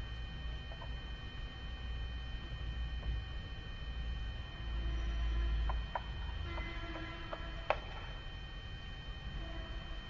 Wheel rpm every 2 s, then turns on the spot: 0, 0, 0, 0, 0.
none